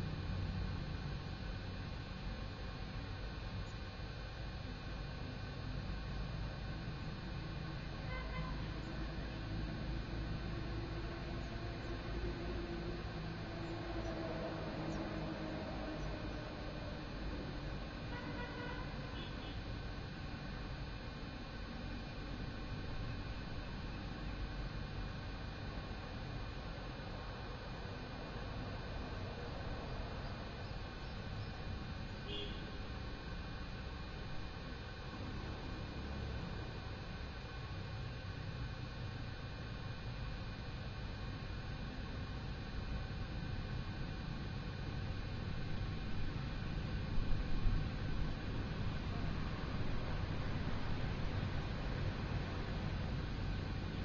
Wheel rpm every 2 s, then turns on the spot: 0, 0, 0, 0, 0, 0, 0, 0, 0, 0, 0, 0, 0, 0, 0, 0, 0, 0, 0, 0, 0, 0, 0, 0, 0, 0, 0.
none